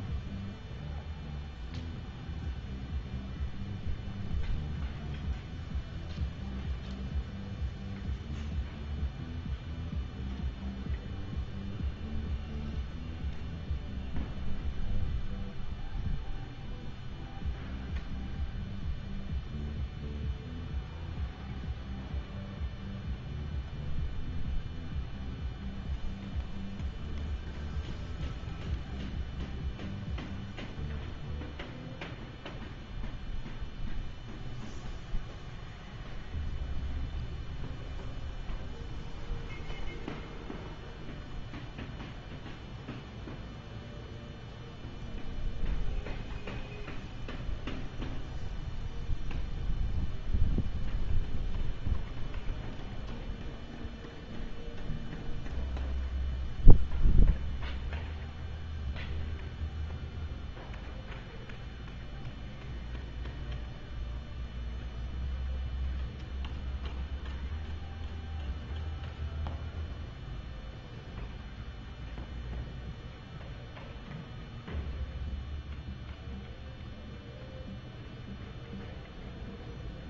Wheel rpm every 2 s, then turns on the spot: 0, 0, 0, 0, 0, 0, 0, 0, 0, 0, 0, 0, 0, 0, 0, 0, 0, 0, 0, 0, 0, 0, 0, 0, 0, 0, 0, 0, 0, 0, 0, 0, 0, 0, 0, 0, 0, 0, 0, 0.
none